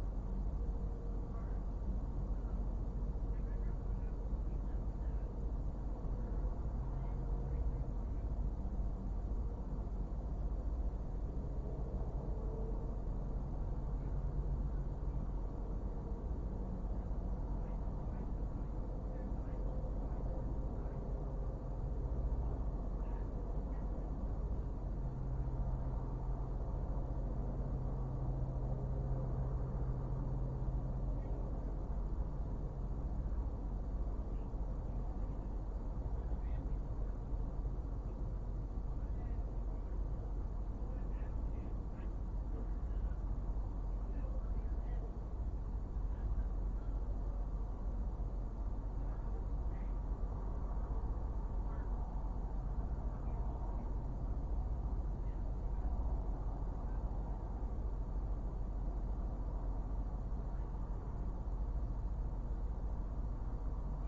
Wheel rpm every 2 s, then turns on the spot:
0, 0, 0, 0, 0, 0, 0, 0, 0, 0, 0, 0, 0, 0, 0, 0, 0, 0, 0, 0, 0, 0, 0, 0, 0, 0, 0, 0, 0, 0, 0, 0.
none